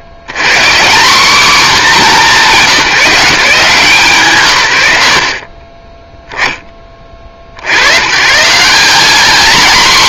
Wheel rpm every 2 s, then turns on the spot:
160, 190, 90, 10, 170.
none